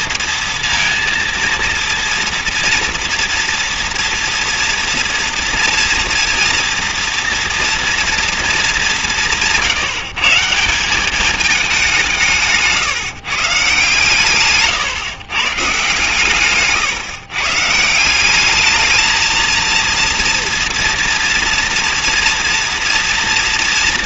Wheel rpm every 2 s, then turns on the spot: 230, 230, 230, 230, 210, 170, 140, 140, 140, 210, 230, 230.
14-18